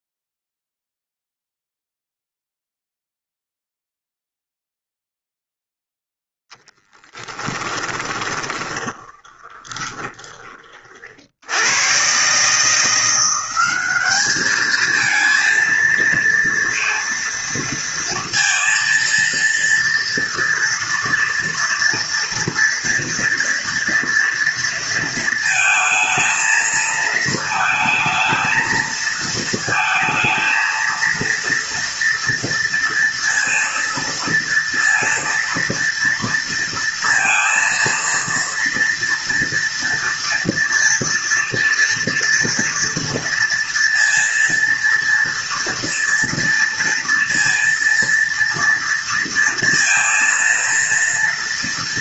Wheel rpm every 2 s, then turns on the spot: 0, 0, 0, 10, 20, 70, 180, 230, 230, 230, 240, 230, 230, 220, 220, 230, 230, 230, 230, 230, 230, 230, 230, 230, 230, 230.
6-10